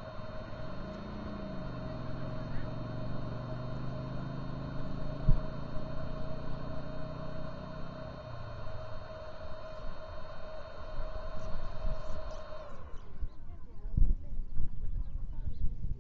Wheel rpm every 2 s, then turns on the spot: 0, 0, 0, 0, 0, 0, 0, 0.
none